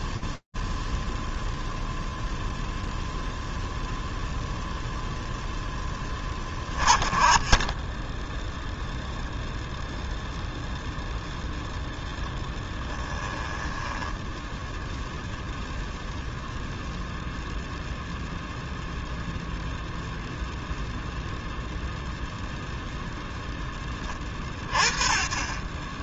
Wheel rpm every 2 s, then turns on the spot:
0, 0, 10, 20, 0, 0, 10, 0, 0, 0, 0, 20, 20.
12-14